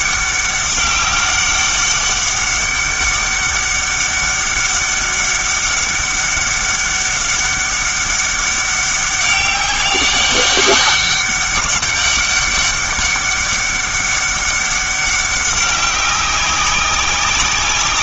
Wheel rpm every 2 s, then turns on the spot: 200, 200, 200, 200, 190, 200, 200, 200, 190.
none